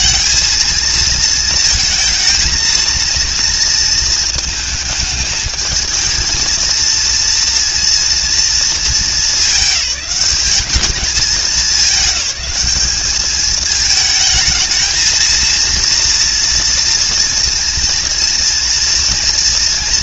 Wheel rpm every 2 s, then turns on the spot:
220, 230, 220, 230, 220, 210, 210, 220, 230, 230.
none